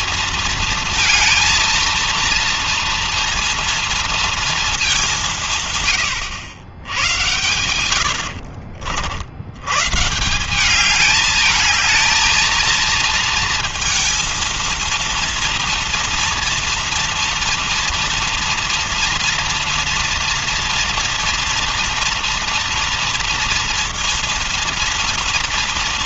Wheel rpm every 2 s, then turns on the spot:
230, 230, 230, 90, 70, 160, 220, 230, 230, 230, 230, 230, 230.
8-10